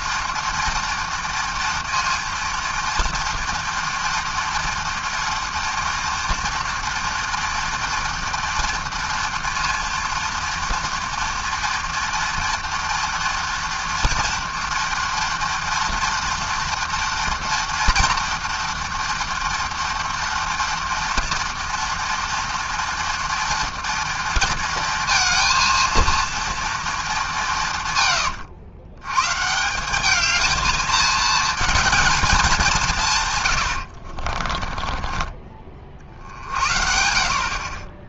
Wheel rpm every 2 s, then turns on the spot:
230, 230, 230, 230, 230, 230, 230, 230, 230, 230, 230, 230, 230, 230, 110, 220, 200, 40, 60.
34-36